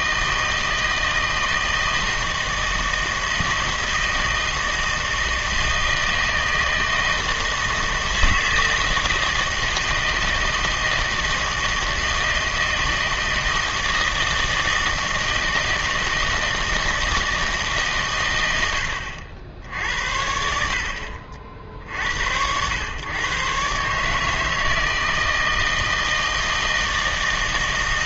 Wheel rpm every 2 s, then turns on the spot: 160, 160, 160, 160, 160, 160, 160, 160, 160, 90, 60, 100, 160, 160.
none